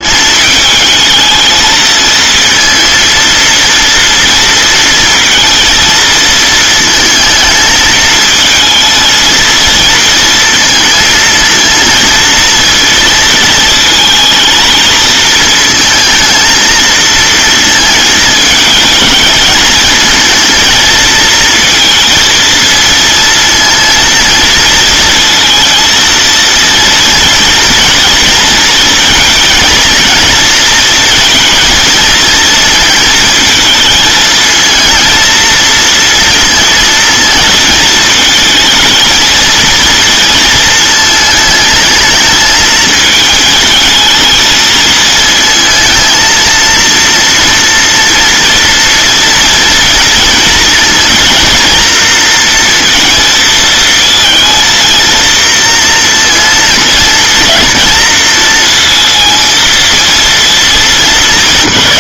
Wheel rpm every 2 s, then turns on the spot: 210, 230, 230, 230, 220, 220, 230, 220, 230, 220, 230, 230, 230, 230, 220, 230, 220, 230, 230, 220, 230, 220, 220, 230, 230, 220, 230, 230, 220, 230, 220.
none